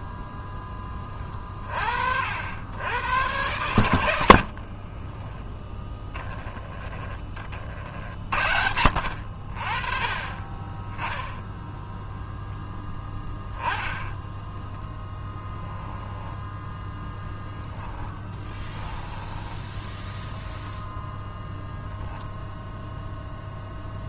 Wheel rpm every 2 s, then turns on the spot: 10, 80, 60, 20, 70, 20, 10, 10, 10, 10, 0, 0.
4-8 14-20